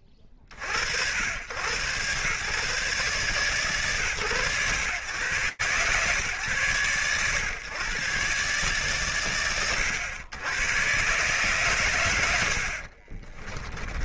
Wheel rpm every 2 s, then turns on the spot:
60, 120, 110, 120, 120, 90, 60.
12-14